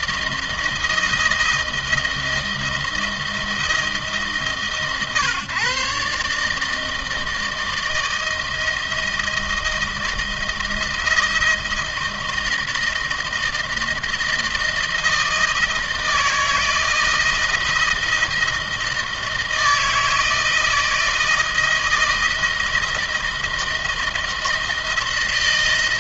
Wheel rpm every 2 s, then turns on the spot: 160, 170, 150, 160, 160, 160, 160, 160, 160, 160, 160, 160, 170.
none